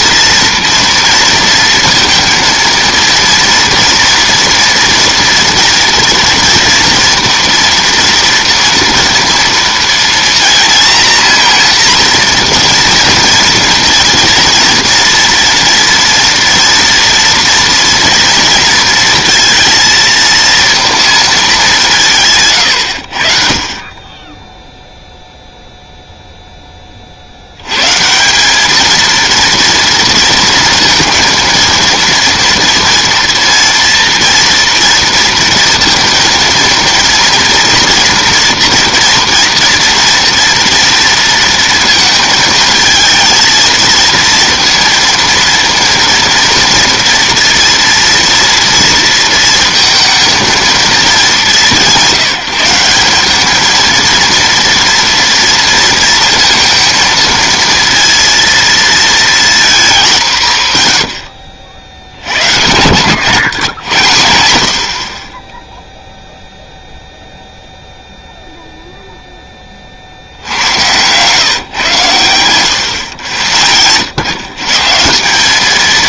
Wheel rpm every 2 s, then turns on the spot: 230, 230, 230, 230, 230, 230, 240, 230, 230, 230, 230, 110, 0, 10, 210, 230, 230, 230, 230, 240, 230, 220, 230, 230, 230, 230, 180, 230, 230, 230, 140, 100, 60, 0, 0, 100, 120, 150.
none